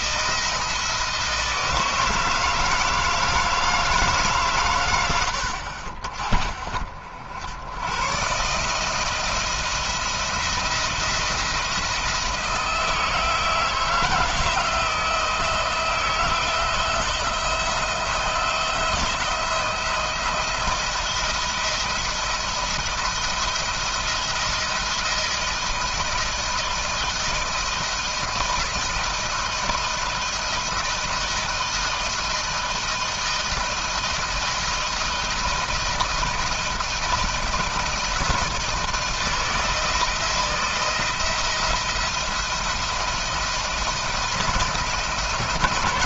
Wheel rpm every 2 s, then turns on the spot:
160, 160, 120, 60, 160, 170, 160, 160, 170, 170, 170, 170, 170, 170, 160, 170, 160, 160, 160, 160, 170, 170, 170.
none